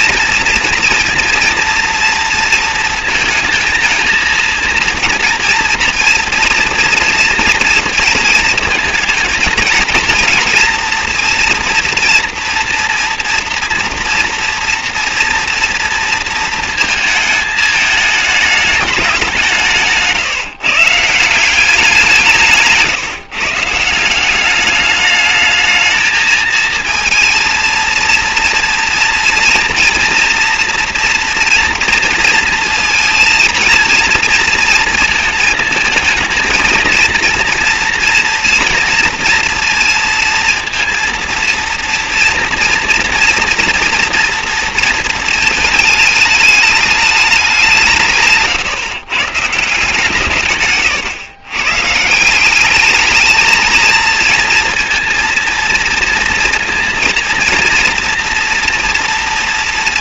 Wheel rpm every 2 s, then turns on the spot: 240, 230, 230, 230, 220, 230, 240, 230, 220, 200, 150, 150, 210, 230, 230, 230, 230, 230, 230, 230, 230, 230, 230, 210, 140, 140, 210, 230, 230, 230.
50-52